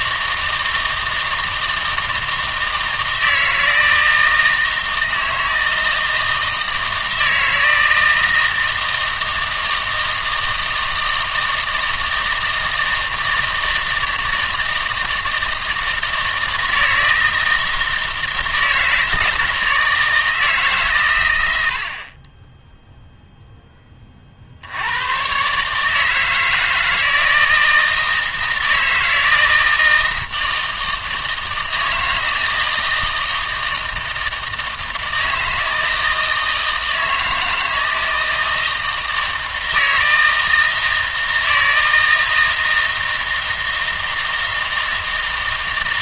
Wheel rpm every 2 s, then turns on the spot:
160, 160, 160, 160, 160, 160, 160, 160, 160, 160, 150, 10, 80, 160, 160, 160, 160, 160, 160, 160, 160, 160, 160.
none